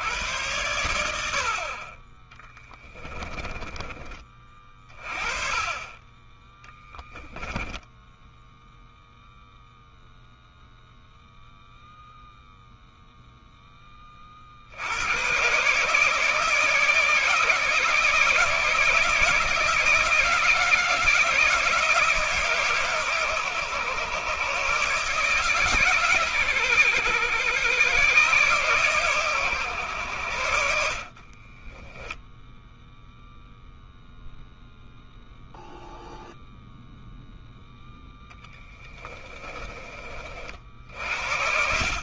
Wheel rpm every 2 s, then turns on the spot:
90, 10, 30, 10, 0, 0, 0, 60, 150, 160, 160, 140, 130, 120, 130, 70, 0, 0, 0, 10, 50.
2-4 6-8 38-40